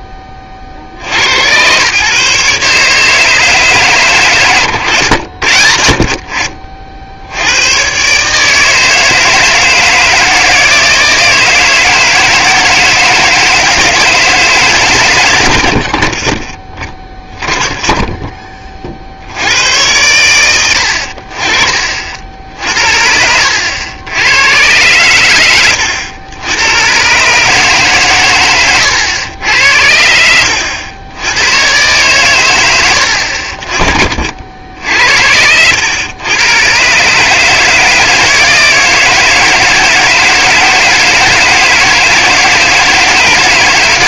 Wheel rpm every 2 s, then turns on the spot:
50, 150, 110, 50, 160, 160, 160, 140, 20, 30, 90, 60, 110, 110, 110, 90, 110, 60, 120, 160, 160, 160.
4-6 22-24 28-30